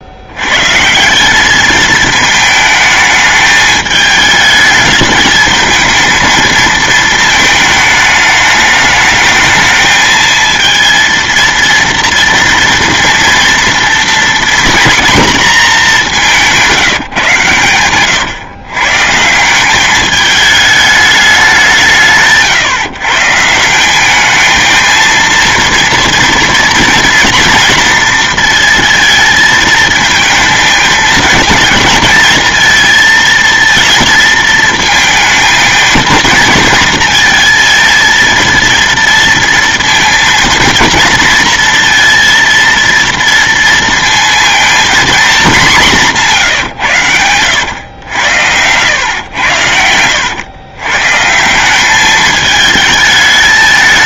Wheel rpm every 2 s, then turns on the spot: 130, 220, 220, 220, 210, 230, 230, 230, 180, 140, 210, 140, 220, 230, 230, 220, 230, 220, 230, 230, 230, 230, 230, 150, 90, 110, 220.
46-50